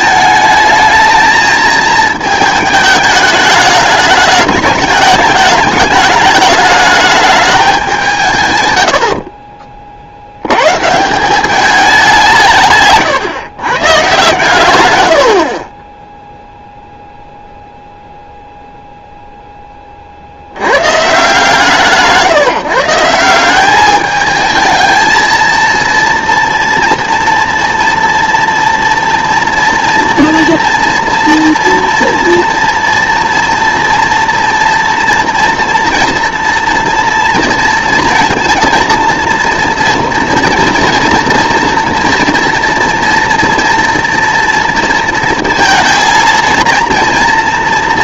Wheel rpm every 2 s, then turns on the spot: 220, 220, 210, 210, 60, 130, 150, 120, 0, 0, 130, 150, 220, 230, 230, 230, 230, 230, 230, 230, 230, 240, 230, 230.
none